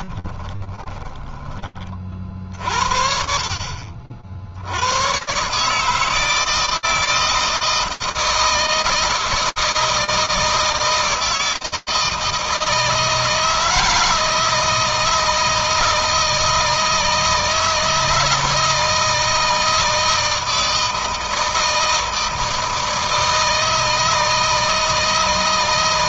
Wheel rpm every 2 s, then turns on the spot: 30, 60, 100, 160, 160, 160, 160, 160, 160, 160, 160, 160, 160.
0-2